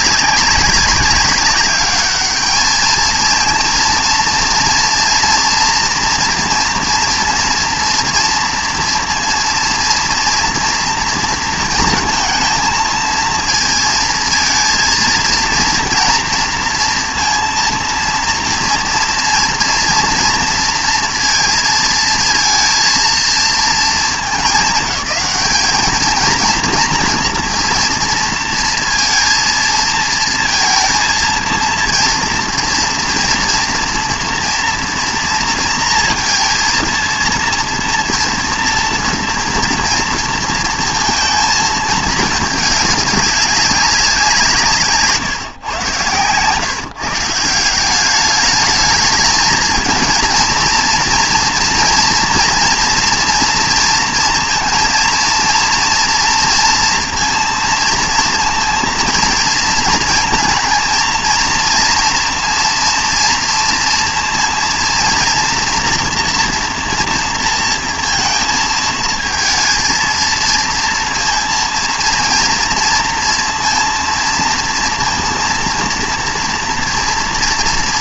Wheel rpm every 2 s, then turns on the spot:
190, 220, 230, 230, 230, 230, 230, 230, 230, 230, 230, 230, 210, 230, 230, 230, 230, 230, 230, 240, 230, 210, 160, 140, 210, 230, 230, 230, 230, 230, 230, 230, 230, 230, 220, 230, 230, 230, 230.
none